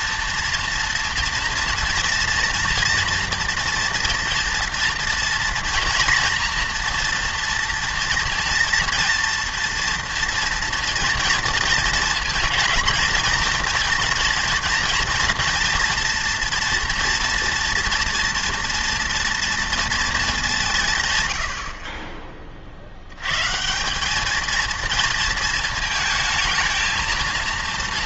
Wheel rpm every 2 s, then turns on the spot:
230, 240, 230, 230, 230, 230, 220, 230, 240, 230, 170, 50, 220, 220.
none